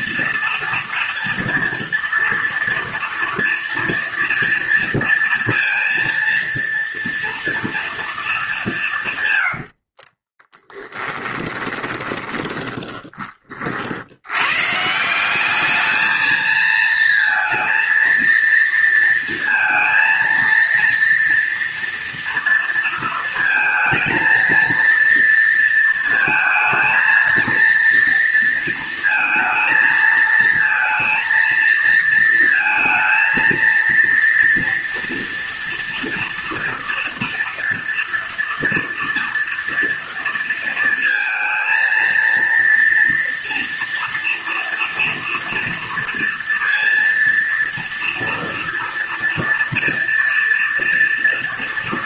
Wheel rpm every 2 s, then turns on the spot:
230, 230, 230, 230, 200, 20, 20, 120, 220, 230, 230, 230, 230, 220, 230, 230, 220, 230, 230, 230, 230, 230, 230, 230, 240, 230.
10-14